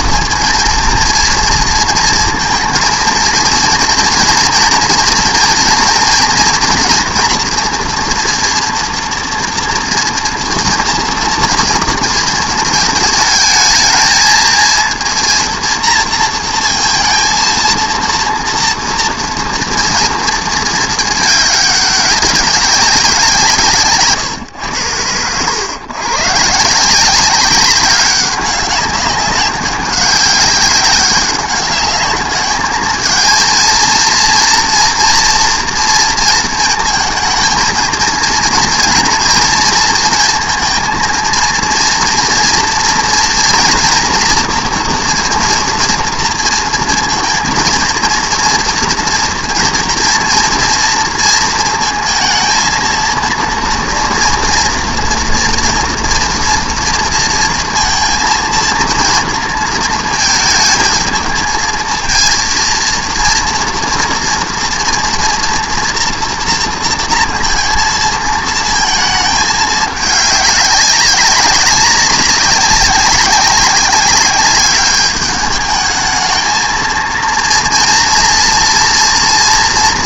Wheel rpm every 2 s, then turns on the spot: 230, 220, 230, 240, 240, 230, 230, 230, 230, 230, 220, 200, 110, 150, 190, 200, 210, 230, 230, 230, 230, 230, 240, 230, 230, 230, 230, 230, 230, 230, 220, 230, 230, 230, 230, 200, 190, 200, 220, 230.
none